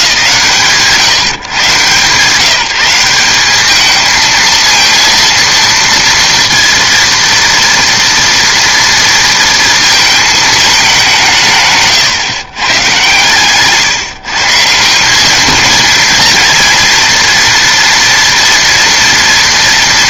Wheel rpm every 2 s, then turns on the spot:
140, 180, 230, 230, 230, 210, 110, 170, 230, 230.
none